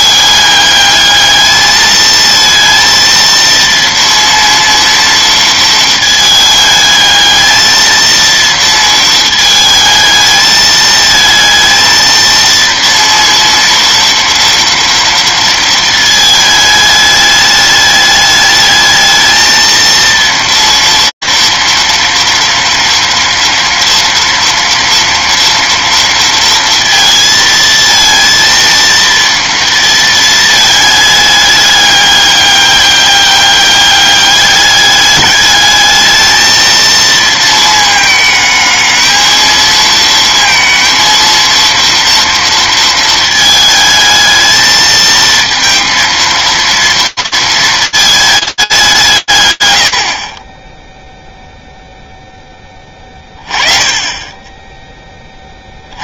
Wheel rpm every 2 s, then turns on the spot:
210, 220, 230, 220, 230, 220, 230, 230, 220, 210, 230, 230, 230, 230, 230, 220, 200, 200, 220, 220, 230, 230, 220, 230, 220, 50, 10, 10.
none